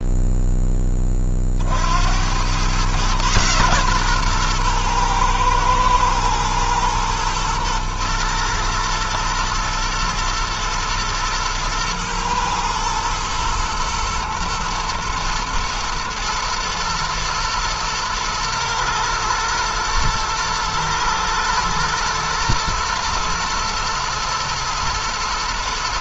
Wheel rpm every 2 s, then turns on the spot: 30, 120, 110, 120, 110, 120, 120, 110, 110, 120, 120, 120, 110.
none